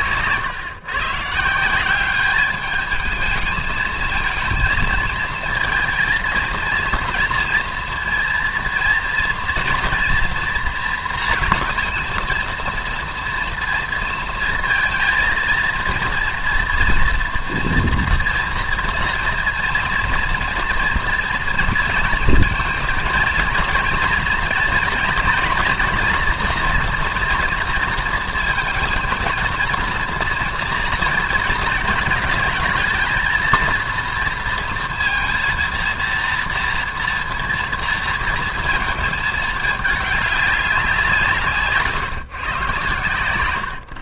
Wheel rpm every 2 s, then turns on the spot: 130, 210, 230, 230, 230, 230, 230, 230, 230, 230, 230, 220, 230, 230, 230, 230, 220, 230, 230, 230, 180, 120.
none